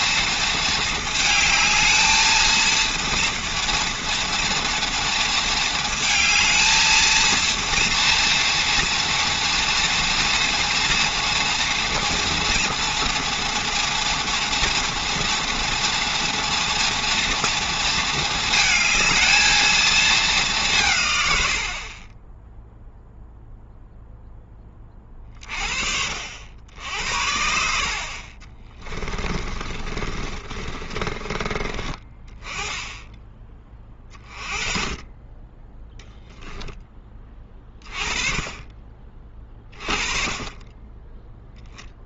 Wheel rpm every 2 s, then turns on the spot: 220, 230, 230, 220, 230, 230, 230, 230, 240, 220, 170, 0, 20, 70, 30, 30, 20, 30, 10, 30, 20.
28-32 36-38